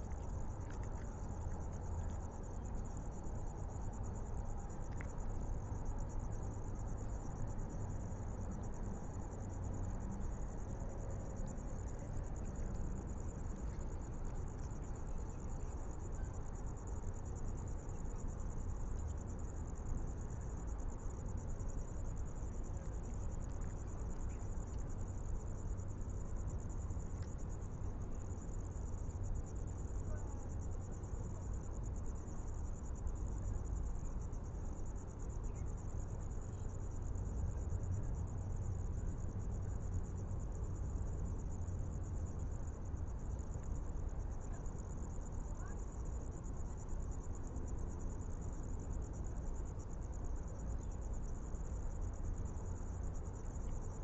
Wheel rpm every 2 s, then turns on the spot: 0, 0, 0, 0, 0, 0, 0, 0, 0, 0, 0, 0, 0, 0, 0, 0, 0, 0, 0, 0, 0, 0, 0, 0, 0, 0, 0.
none